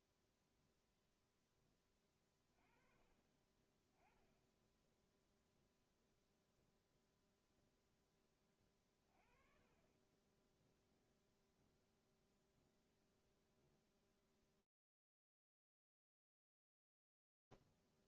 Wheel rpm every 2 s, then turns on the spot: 0, 20, 10, 0, 30, 0, 0, 0, 0.
none